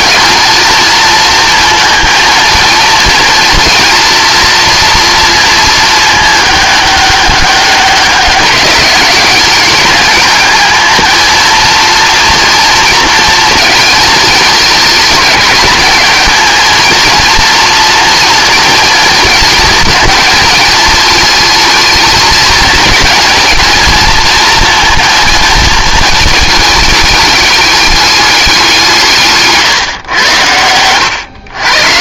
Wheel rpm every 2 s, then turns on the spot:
230, 230, 230, 210, 200, 220, 230, 220, 230, 230, 220, 210, 230, 210, 180, 110.
none